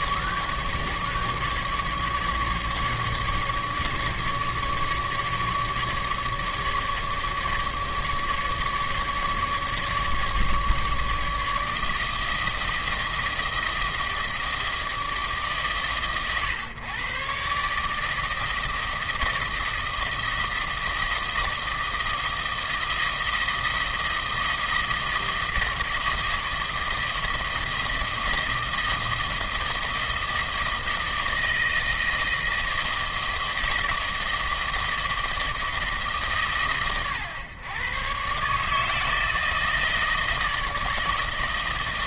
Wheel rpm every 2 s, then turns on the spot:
150, 150, 150, 150, 150, 150, 160, 160, 120, 160, 160, 160, 160, 160, 160, 160, 160, 160, 130, 150, 160.
none